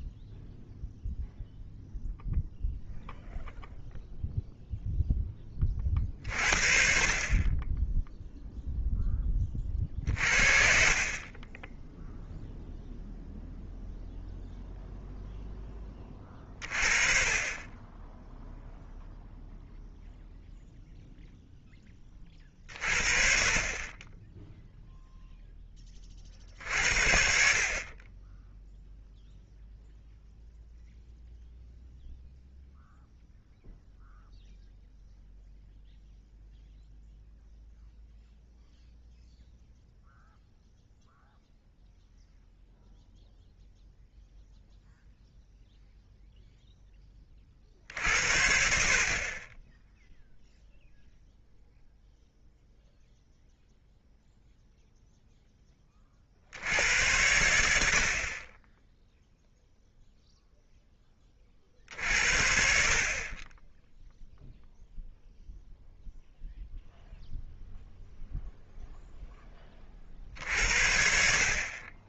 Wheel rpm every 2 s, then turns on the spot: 0, 0, 20, 30, 30, 20, 0, 10, 30, 0, 0, 40, 0, 60, 0, 0, 0, 0, 0, 0, 0, 0, 0, 10, 60, 0, 0, 0, 80, 10, 10, 40, 0, 0, 0, 60.
none